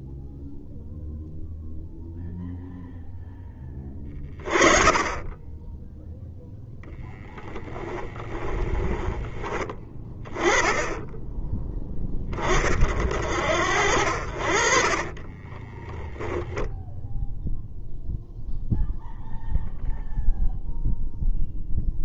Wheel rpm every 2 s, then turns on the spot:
0, 0, 30, 0, 10, 20, 30, 50, 10, 0, 0.
8-10